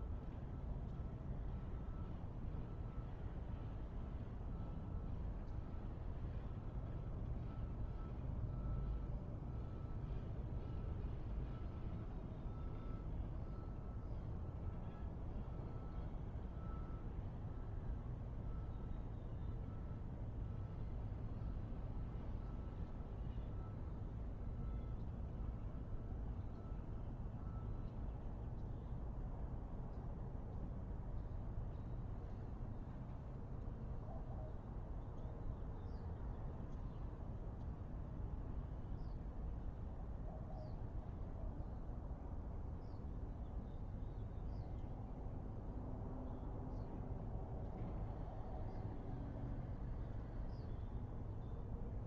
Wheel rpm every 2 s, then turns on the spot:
0, 0, 0, 0, 0, 0, 0, 0, 0, 0, 0, 0, 0, 0, 0, 0, 0, 0, 0, 0, 0, 0, 0, 0, 0, 0.
none